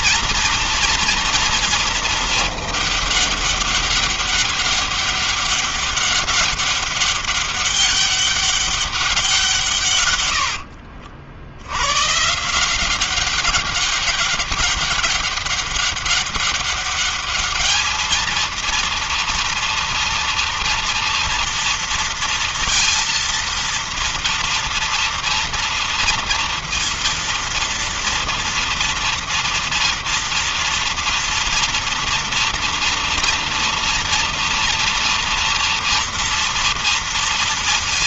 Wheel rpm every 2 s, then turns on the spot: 230, 200, 200, 200, 190, 80, 190, 200, 200, 230, 230, 230, 230, 230, 230, 230, 230, 230, 230.
none